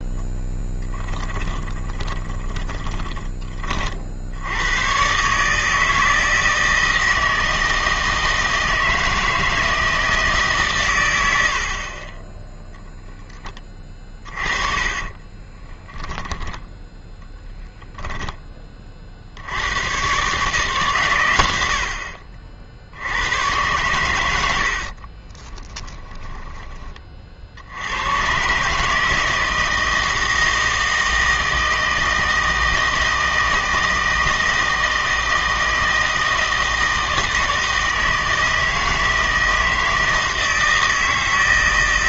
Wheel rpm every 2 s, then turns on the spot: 10, 20, 90, 160, 160, 130, 0, 30, 10, 20, 140, 50, 70, 10, 140, 160, 160, 160, 160, 160, 160.
0-4 14-16 24-26